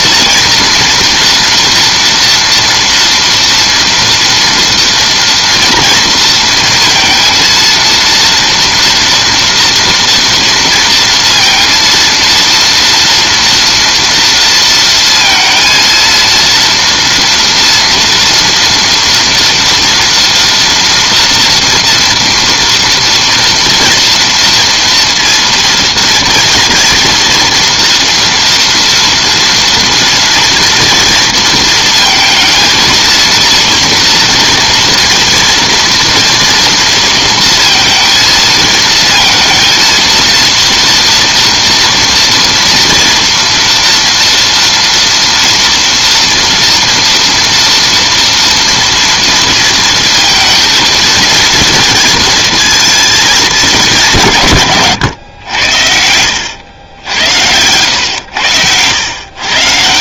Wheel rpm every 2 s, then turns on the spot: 240, 230, 230, 230, 230, 230, 230, 230, 240, 230, 230, 230, 230, 240, 240, 230, 230, 230, 230, 230, 230, 230, 240, 230, 230, 230, 230, 120, 90, 100.
none